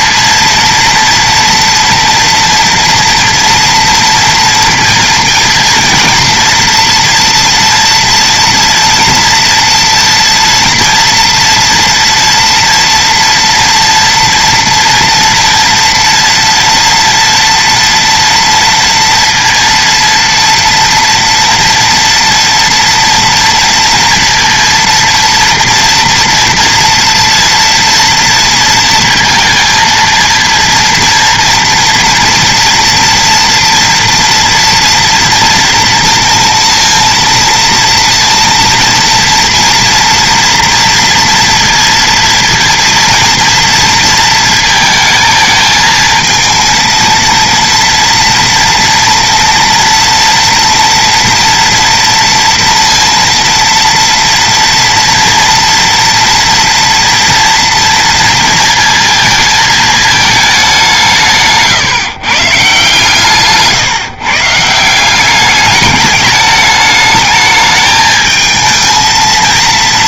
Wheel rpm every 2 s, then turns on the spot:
230, 230, 230, 230, 240, 230, 230, 230, 230, 230, 230, 230, 230, 230, 230, 230, 240, 240, 230, 230, 230, 230, 220, 220, 230, 230, 230, 230, 230, 230, 200, 140, 160, 210, 220.
none